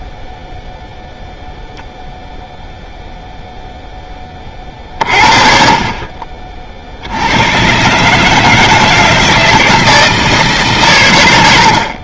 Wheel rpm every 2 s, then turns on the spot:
0, 0, 40, 50, 160, 150.
none